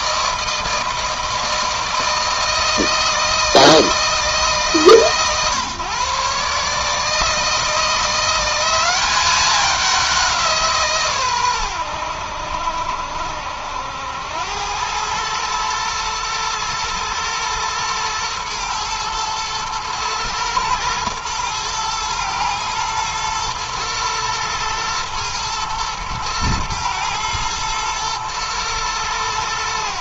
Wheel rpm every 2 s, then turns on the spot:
160, 160, 140, 150, 190, 140, 70, 100, 120, 120, 110, 110, 110, 120, 110.
none